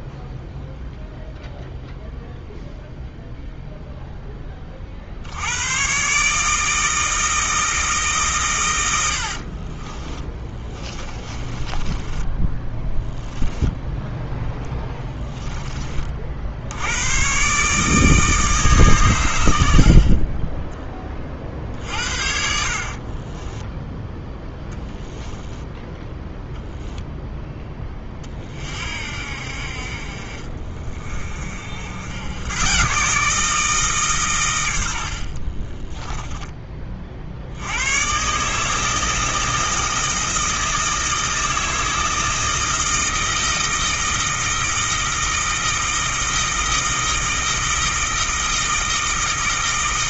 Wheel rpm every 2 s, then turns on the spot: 0, 0, 60, 160, 90, 20, 10, 10, 100, 120, 20, 30, 0, 0, 50, 40, 140, 70, 40, 160, 160, 160, 160, 160, 160.
10-12 22-24 34-36